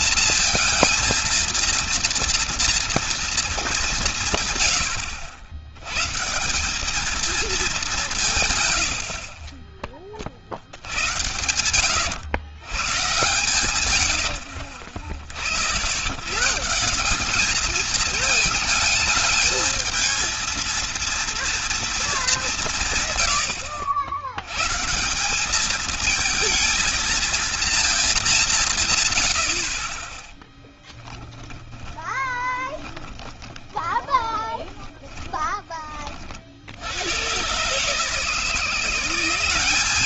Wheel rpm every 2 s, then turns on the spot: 230, 230, 120, 170, 140, 80, 110, 50, 160, 220, 230, 180, 120, 230, 160, 10, 30, 20, 70, 170.
30-36